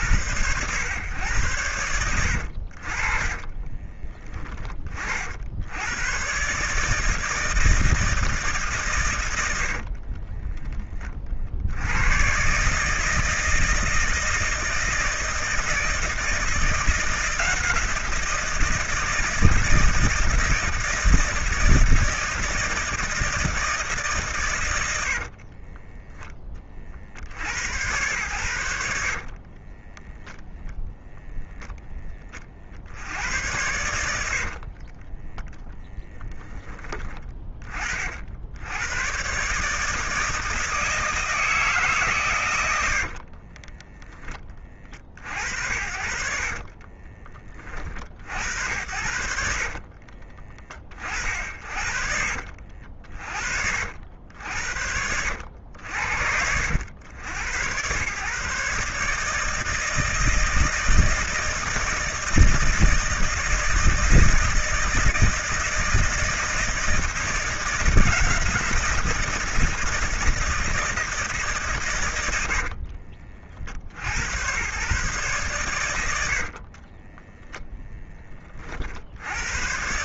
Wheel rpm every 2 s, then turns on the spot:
110, 60, 20, 140, 150, 20, 140, 160, 170, 170, 160, 160, 120, 30, 80, 0, 50, 60, 10, 80, 160, 110, 40, 40, 70, 30, 50, 80, 80, 140, 160, 160, 160, 160, 170, 160, 70, 120, 50, 40.
10-12 34-36 46-48 52-54 72-74 76-78